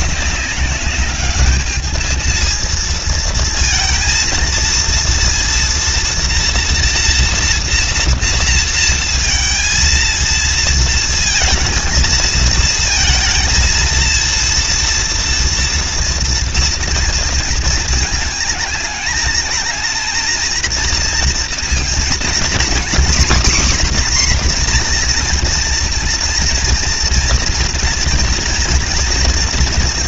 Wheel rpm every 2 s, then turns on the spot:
200, 230, 230, 230, 230, 230, 230, 230, 230, 220, 230, 230, 260, 230, 230.
none